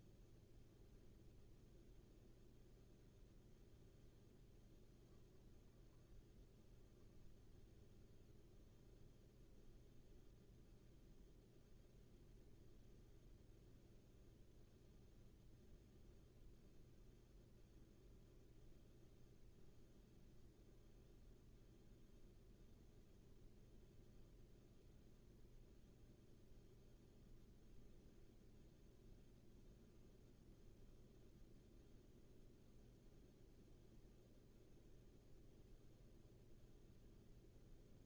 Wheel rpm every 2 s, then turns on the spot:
0, 0, 0, 0, 0, 0, 0, 0, 0, 0, 0, 0, 0, 0, 0, 0, 0, 0, 0.
none